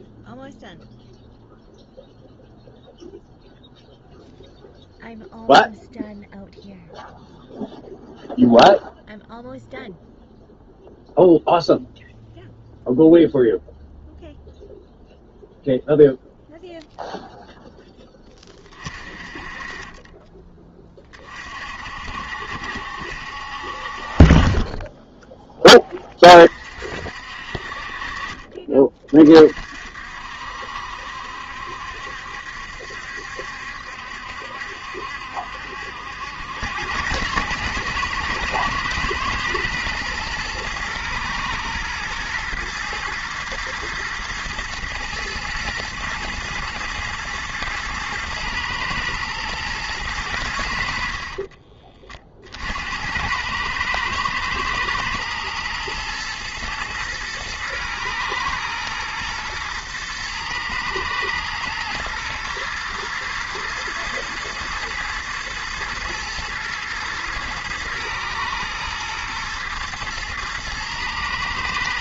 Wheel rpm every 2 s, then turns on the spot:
0, 0, 0, 0, 0, 0, 0, 0, 0, 30, 30, 60, 10, 50, 40, 70, 70, 70, 100, 110, 110, 120, 120, 120, 110, 70, 80, 110, 120, 110, 110, 120, 110, 120, 110, 110.
none